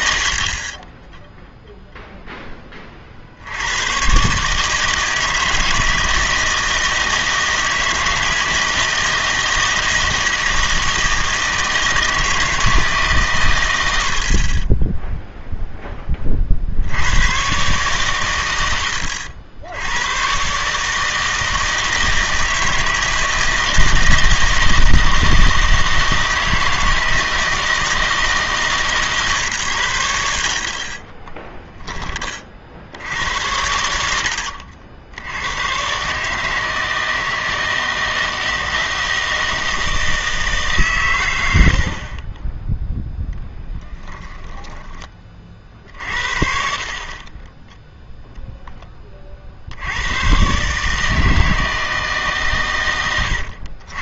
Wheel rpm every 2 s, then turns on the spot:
30, 10, 150, 160, 160, 160, 160, 20, 50, 90, 140, 160, 160, 160, 150, 50, 60, 70, 160, 160, 150, 10, 20, 50, 10, 130, 130.
0-2